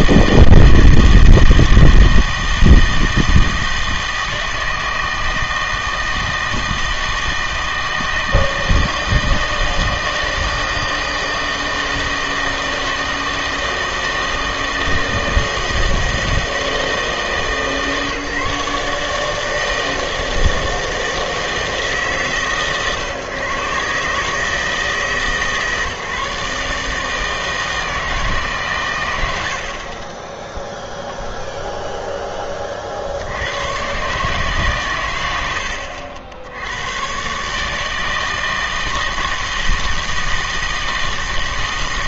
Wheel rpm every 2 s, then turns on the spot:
160, 160, 160, 160, 160, 160, 160, 160, 160, 150, 160, 130, 160, 150, 130, 0, 30, 140, 90, 160, 160.
none